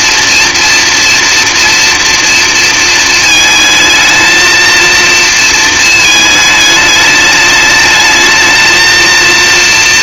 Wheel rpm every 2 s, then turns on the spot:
230, 230, 230, 210, 220.
none